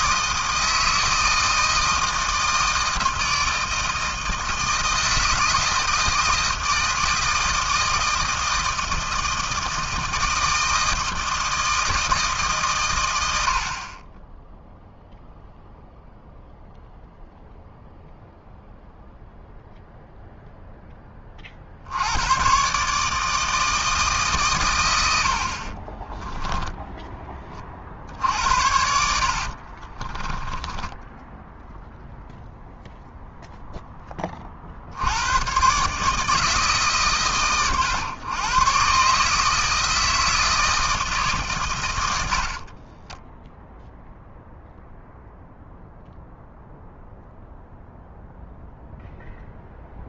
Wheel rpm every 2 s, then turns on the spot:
160, 160, 160, 160, 160, 160, 140, 10, 0, 0, 0, 120, 140, 10, 80, 20, 0, 40, 160, 120, 160, 70, 0, 0, 0.
26-32 42-44